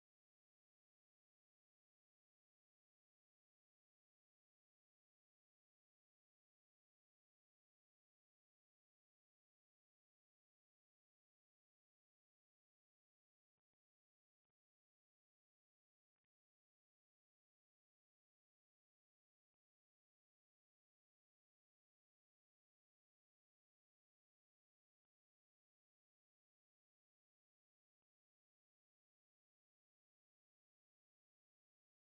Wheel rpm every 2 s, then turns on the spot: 0, 0, 0, 0, 0, 0, 0, 0, 0, 0, 0, 0, 0, 0, 0, 0.
none